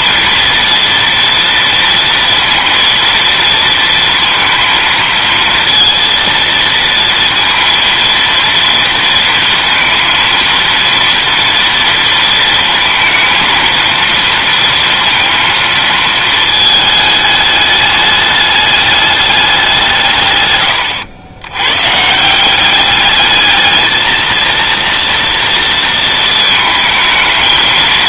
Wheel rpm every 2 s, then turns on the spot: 240, 230, 230, 230, 230, 230, 230, 230, 220, 210, 110, 190, 230, 220.
none